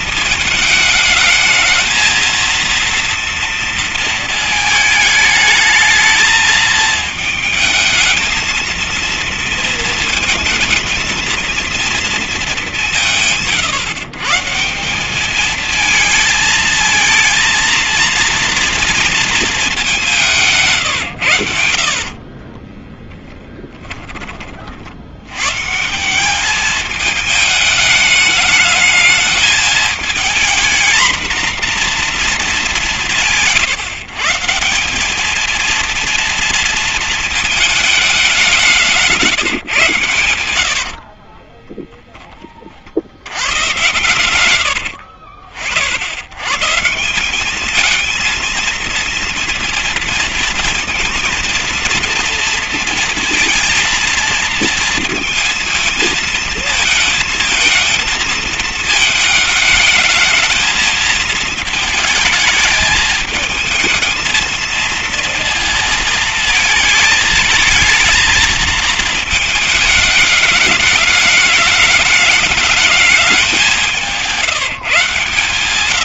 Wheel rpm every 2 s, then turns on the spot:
210, 230, 220, 220, 220, 230, 180, 180, 220, 230, 150, 20, 60, 210, 210, 230, 200, 190, 230, 180, 70, 40, 80, 150, 230, 230, 230, 230, 220, 220, 220, 220, 230, 220, 220, 210, 210, 150.
22-24 40-42 44-46